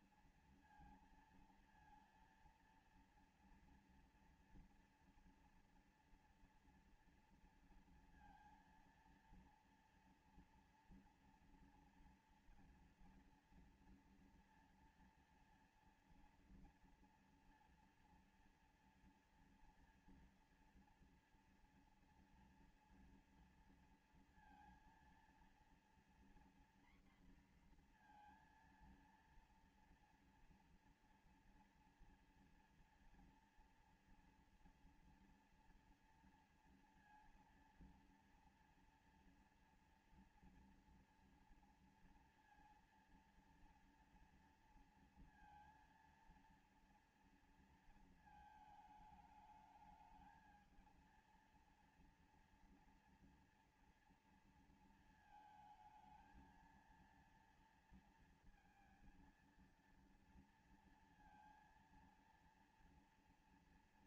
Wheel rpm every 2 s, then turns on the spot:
230, 230, 230, 230, 230, 230, 240, 230, 230, 230, 230, 230, 230, 240, 230, 230, 230, 230, 230, 230, 230, 230, 230, 230, 220, 220, 230, 230, 230, 230, 230, 230.
none